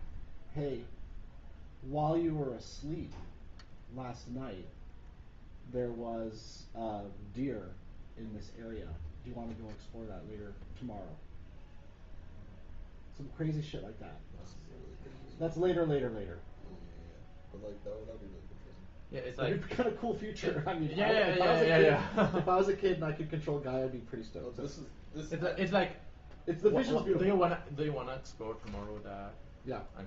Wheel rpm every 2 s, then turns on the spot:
0, 0, 0, 0, 0, 0, 0, 0, 0, 0, 0, 0, 0, 0, 0.
none